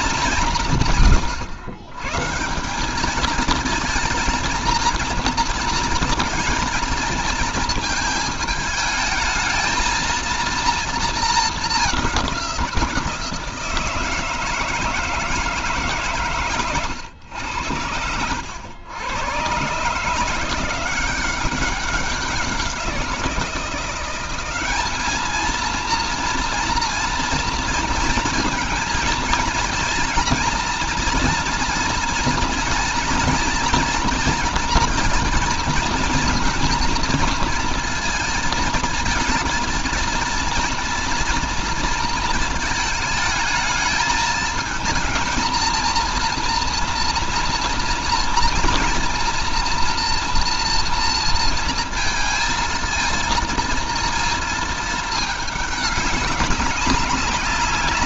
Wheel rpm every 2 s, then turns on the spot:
160, 180, 220, 220, 220, 230, 180, 160, 120, 90, 170, 180, 200, 230, 230, 240, 230, 230, 230, 230, 230, 220, 220, 230, 230, 230, 230, 220, 190.
none